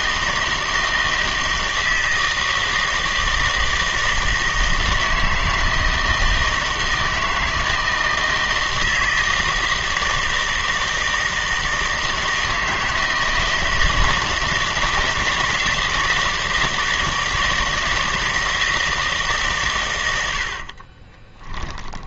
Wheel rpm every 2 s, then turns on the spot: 160, 160, 160, 160, 160, 160, 160, 160, 160, 160, 70.
none